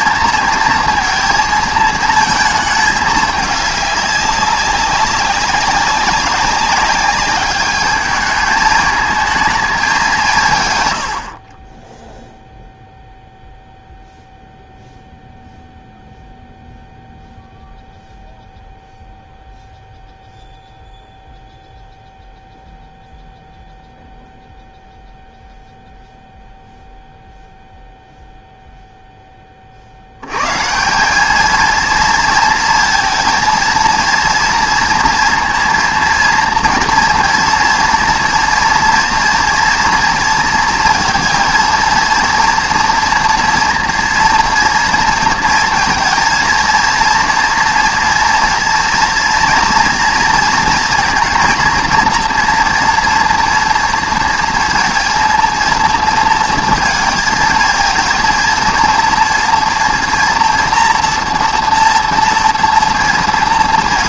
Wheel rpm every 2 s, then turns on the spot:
230, 220, 190, 200, 210, 120, 0, 0, 0, 0, 0, 0, 0, 0, 0, 150, 230, 230, 230, 230, 230, 240, 230, 230, 230, 230, 240, 230, 230, 230, 230, 230.
none